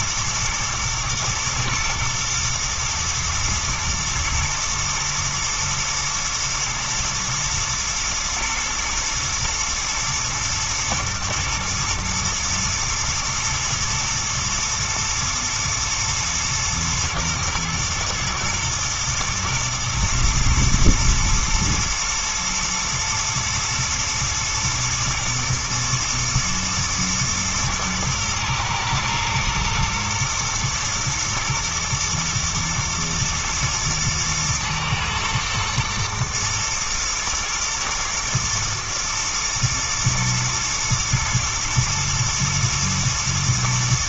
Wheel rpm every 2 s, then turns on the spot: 120, 120, 120, 120, 110, 120, 110, 110, 120, 120, 110, 110, 110, 110, 110, 120, 120, 110, 120, 120, 110, 110.
none